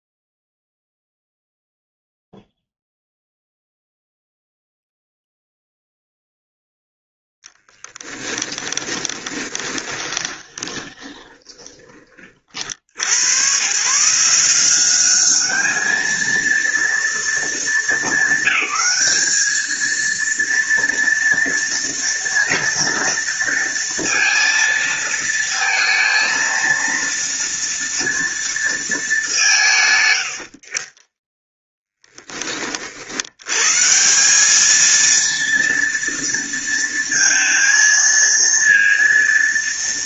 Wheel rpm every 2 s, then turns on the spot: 0, 0, 0, 0, 10, 20, 80, 190, 230, 200, 230, 230, 230, 230, 220, 50, 50, 220, 230, 230.
8-12